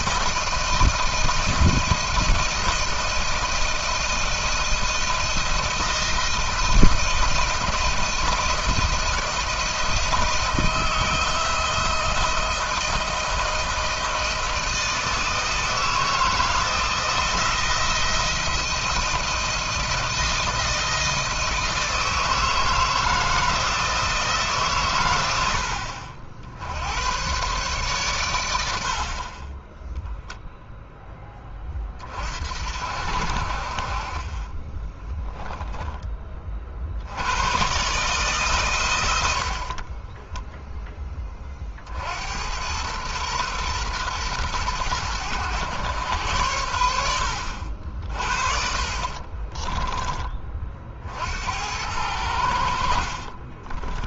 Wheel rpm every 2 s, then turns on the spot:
160, 170, 170, 170, 160, 160, 160, 160, 160, 170, 170, 160, 140, 70, 90, 0, 60, 20, 30, 130, 10, 90, 110, 90, 40, 30, 80.
48-50